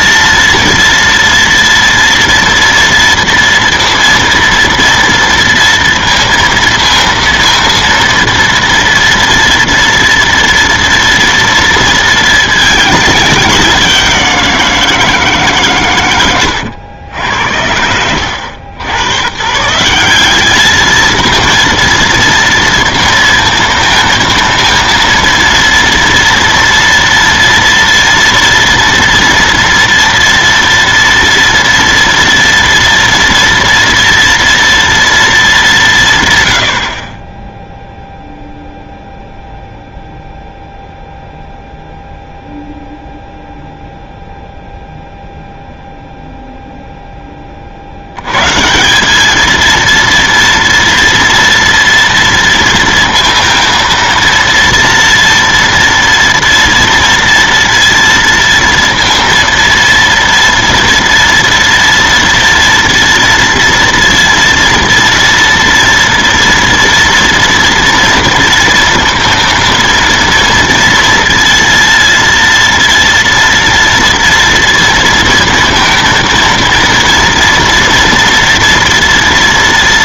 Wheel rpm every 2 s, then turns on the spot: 230, 230, 230, 230, 230, 230, 220, 170, 100, 110, 210, 230, 230, 230, 230, 230, 230, 240, 120, 0, 0, 0, 0, 0, 130, 230, 230, 230, 230, 230, 230, 230, 230, 230, 230, 230, 230, 230, 230, 230.
none